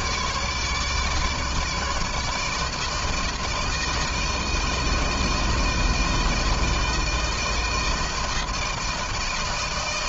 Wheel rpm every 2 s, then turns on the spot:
150, 160, 160, 160, 160.
none